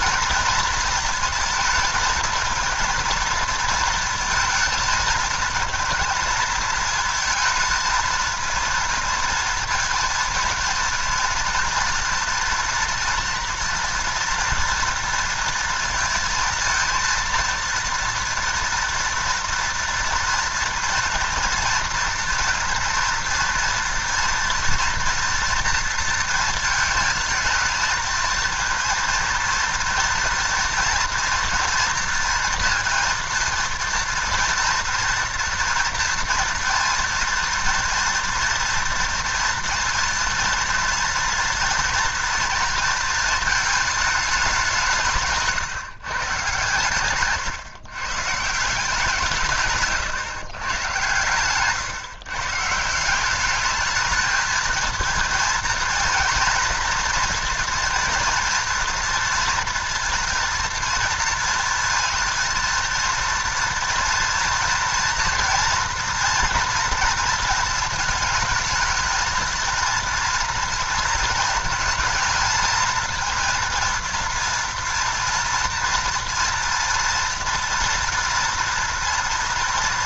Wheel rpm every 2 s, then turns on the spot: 230, 230, 230, 220, 230, 230, 230, 230, 230, 230, 230, 230, 230, 220, 230, 230, 230, 230, 230, 230, 230, 220, 160, 130, 160, 130, 160, 230, 230, 230, 230, 230, 230, 240, 220, 230, 230, 230, 230, 230.
none